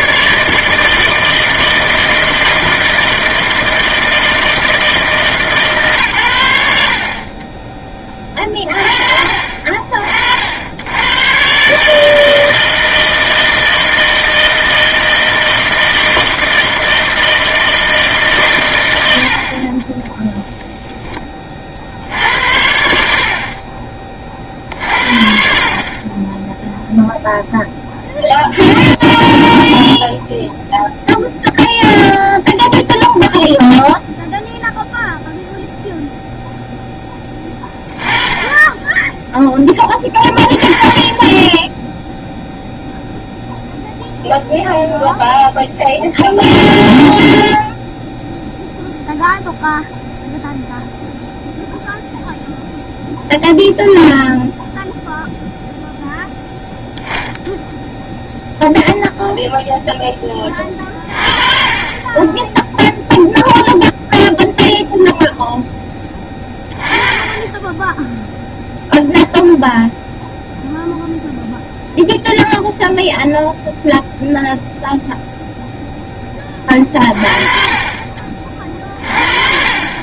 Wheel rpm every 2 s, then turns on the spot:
160, 160, 160, 70, 40, 90, 160, 160, 160, 100, 0, 70, 50, 0, 0, 0, 0, 0, 10, 10, 30, 0, 0, 0, 0, 0, 0, 0, 0, 0, 30, 0, 0, 20, 0, 0, 0, 0, 30, 40.
none